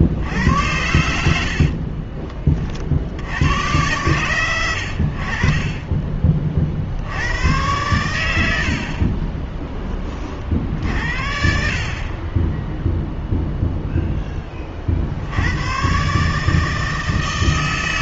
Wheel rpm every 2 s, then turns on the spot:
90, 20, 110, 40, 80, 60, 10, 20, 150.
none